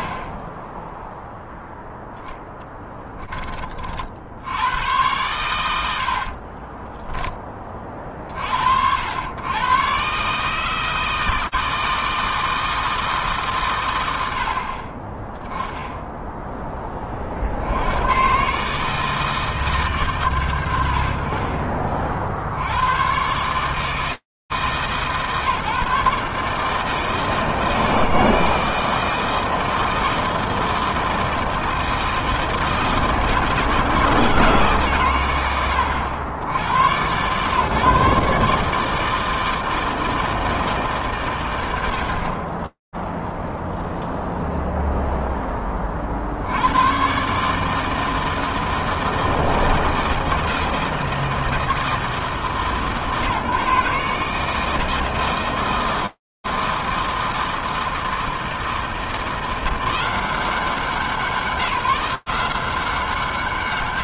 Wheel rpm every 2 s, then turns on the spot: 10, 10, 90, 30, 60, 150, 160, 70, 10, 120, 100, 80, 150, 160, 160, 160, 160, 140, 110, 150, 160, 20, 0, 80, 160, 160, 140, 150, 160, 160, 170, 180.
2-4 6-8